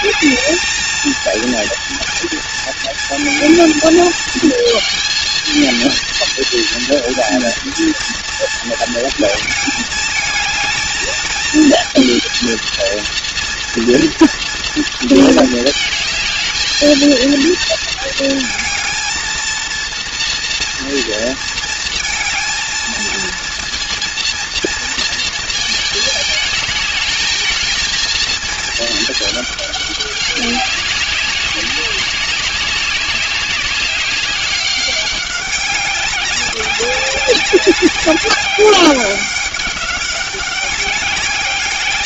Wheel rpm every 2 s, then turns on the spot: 230, 230, 230, 230, 230, 220, 230, 230, 220, 220, 230, 220, 230, 220, 220, 200, 190, 190, 200, 200, 190.
none